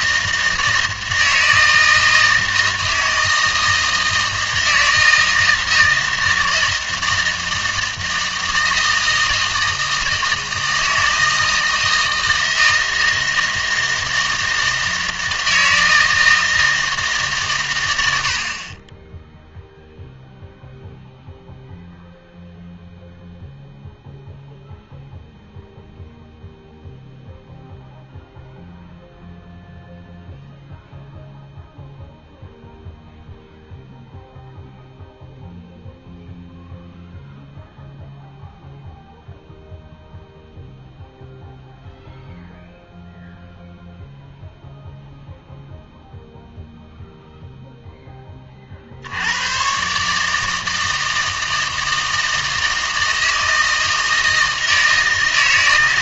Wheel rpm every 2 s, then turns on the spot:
160, 160, 160, 160, 160, 160, 160, 160, 160, 30, 0, 0, 0, 0, 0, 0, 0, 0, 0, 0, 0, 0, 0, 0, 50, 160, 160, 160.
none